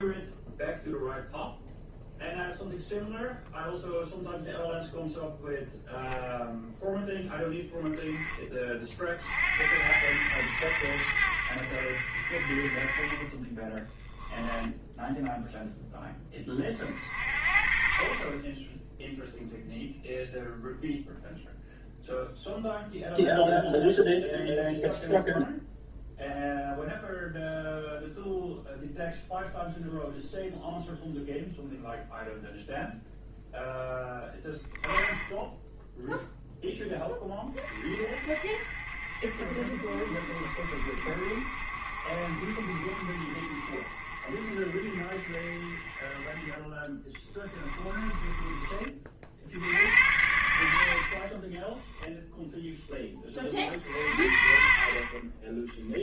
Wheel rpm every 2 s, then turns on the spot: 0, 0, 0, 0, 40, 90, 30, 10, 30, 10, 0, 0, 0, 0, 0, 0, 0, 10, 10, 40, 40, 50, 40, 20, 30, 60, 10, 40.
none